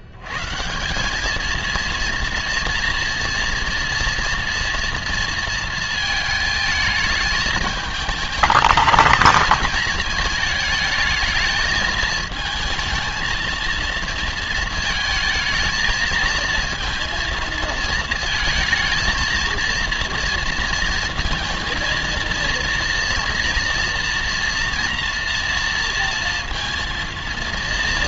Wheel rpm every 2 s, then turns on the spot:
110, 230, 230, 220, 220, 220, 220, 230, 230, 220, 230, 230, 230, 230.
none